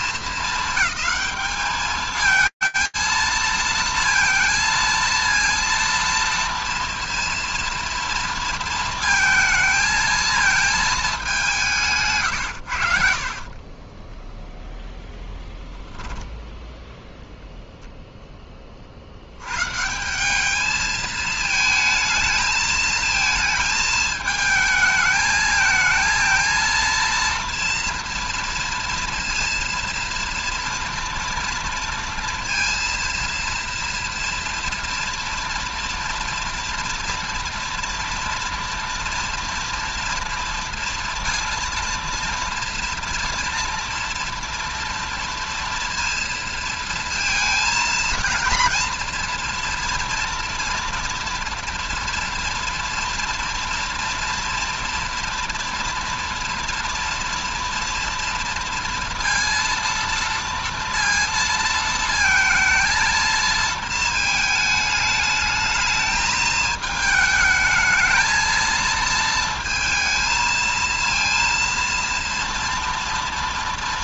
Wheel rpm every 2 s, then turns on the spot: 220, 230, 230, 230, 230, 220, 70, 10, 0, 50, 220, 220, 220, 230, 230, 230, 230, 230, 230, 230, 230, 230, 230, 230, 230, 230, 230, 230, 230, 230, 230, 230, 220, 220, 220, 230, 230.
12-14